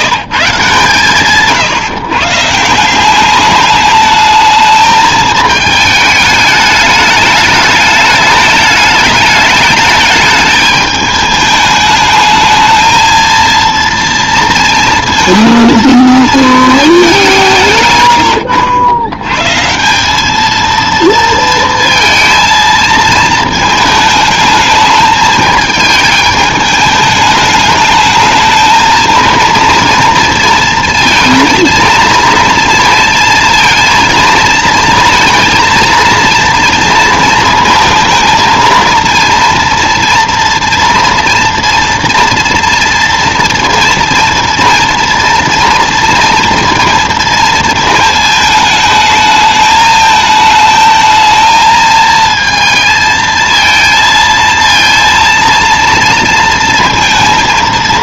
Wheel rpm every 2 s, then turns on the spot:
160, 170, 220, 210, 210, 210, 220, 230, 220, 80, 230, 230, 220, 210, 220, 230, 230, 230, 230, 230, 230, 230, 230, 230, 220, 220, 220, 230, 230.
none